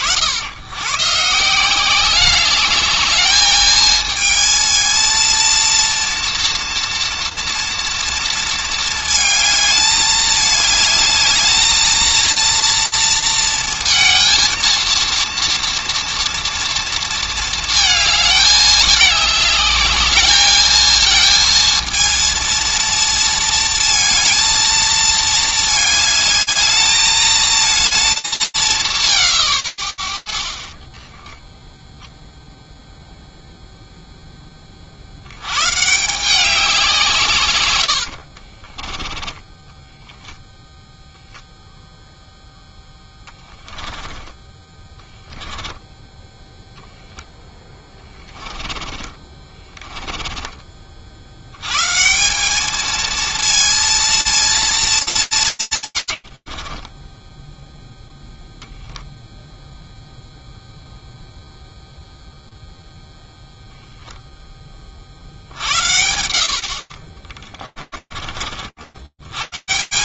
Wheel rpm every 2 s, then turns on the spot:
160, 210, 230, 230, 220, 210, 230, 230, 230, 210, 230, 230, 210, 220, 180, 20, 0, 120, 120, 10, 0, 10, 10, 20, 20, 140, 230, 130, 10, 0, 0, 0, 80, 30, 190.
36-40 42-44 46-50 56-58 66-68